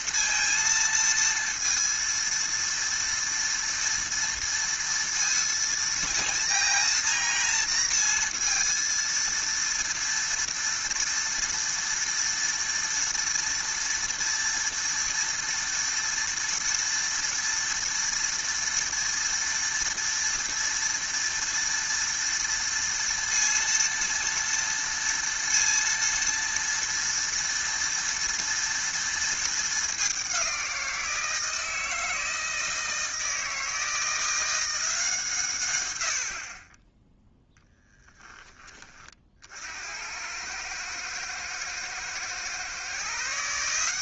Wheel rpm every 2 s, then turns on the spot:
230, 230, 230, 230, 230, 230, 230, 230, 230, 230, 230, 230, 230, 230, 230, 180, 160, 170, 30, 20, 110, 140.
none